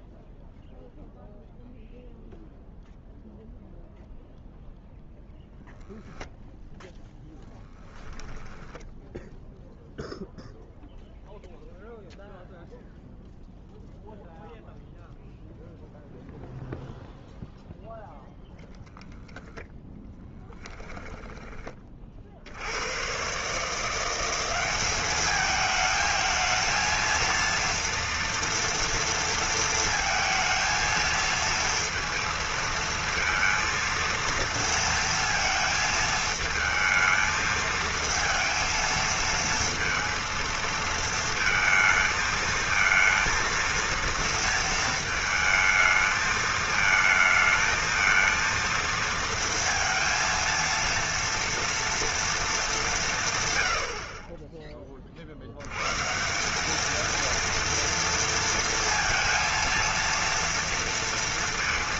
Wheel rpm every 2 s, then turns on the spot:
0, 0, 0, 0, 10, 0, 0, 0, 0, 0, 10, 70, 200, 220, 230, 220, 230, 230, 220, 230, 230, 230, 220, 220, 230, 230, 200, 20, 210, 230, 230.
8-10 20-22